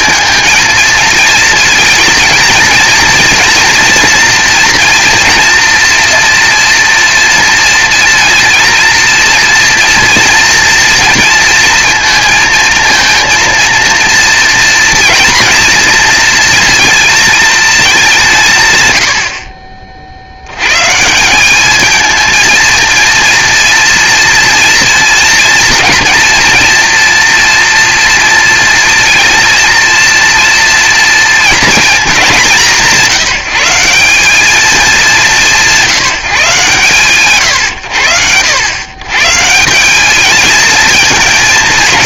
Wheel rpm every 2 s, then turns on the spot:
230, 230, 230, 230, 230, 230, 230, 230, 230, 200, 60, 220, 230, 230, 230, 230, 210, 180, 140, 120, 220.
none